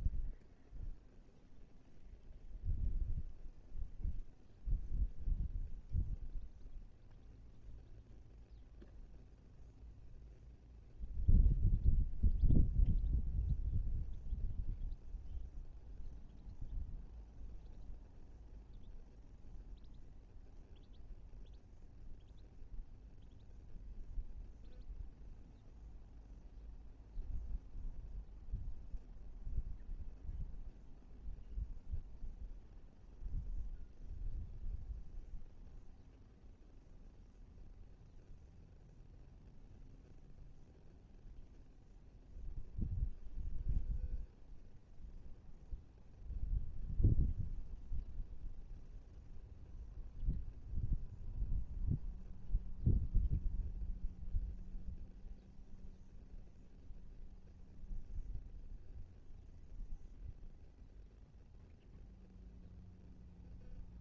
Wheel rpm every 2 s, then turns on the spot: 0, 0, 0, 0, 0, 0, 0, 0, 0, 0, 0, 0, 0, 0, 0, 0, 0, 0, 0, 0, 0, 0, 0, 0, 0, 0, 0, 0, 0, 0, 0, 0.
none